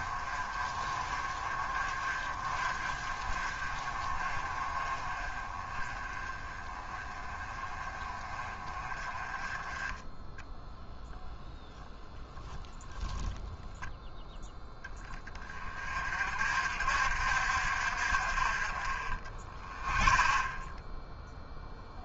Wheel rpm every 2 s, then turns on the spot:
30, 30, 30, 20, 20, 0, 0, 10, 60, 20, 0.
18-20